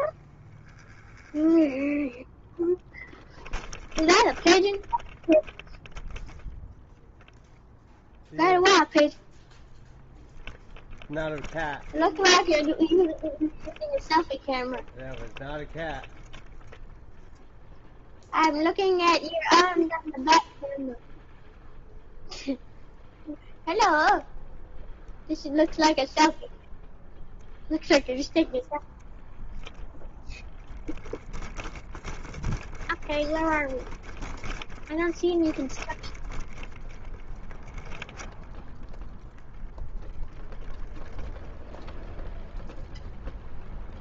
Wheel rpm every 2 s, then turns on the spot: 20, 0, 0, 0, 0, 0, 0, 0, 0, 0, 0, 0, 0, 0, 0, 0, 0, 0, 0, 0, 0, 0.
0-2